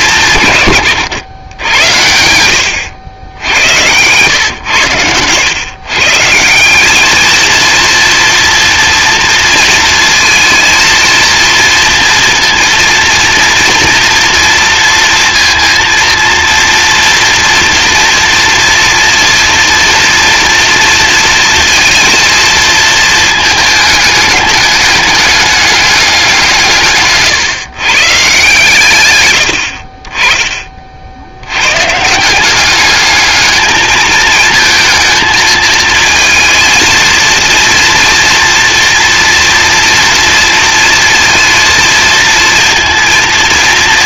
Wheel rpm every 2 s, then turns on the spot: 130, 100, 110, 170, 230, 230, 230, 230, 230, 230, 230, 220, 210, 160, 140, 30, 190, 220, 230, 230, 230, 230.
none